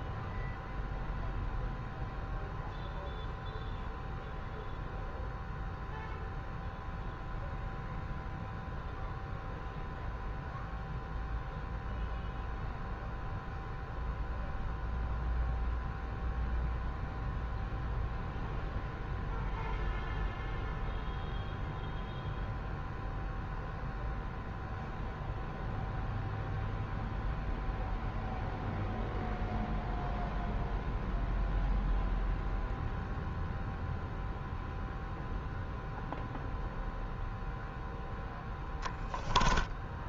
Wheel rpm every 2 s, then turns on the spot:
0, 0, 0, 0, 0, 0, 0, 0, 0, 0, 0, 0, 0, 0, 0, 0, 0, 0, 0, 10.
none